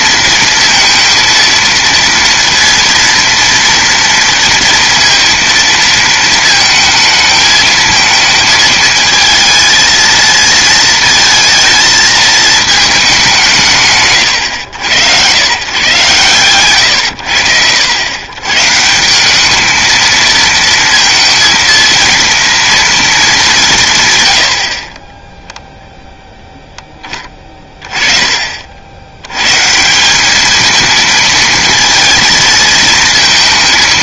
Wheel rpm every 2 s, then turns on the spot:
230, 230, 230, 220, 220, 220, 220, 100, 130, 130, 230, 230, 60, 10, 50, 220, 220.
none